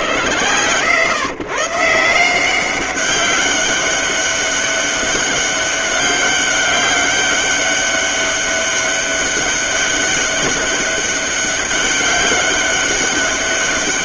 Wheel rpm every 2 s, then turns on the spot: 110, 190, 200, 200, 200, 200, 200.
none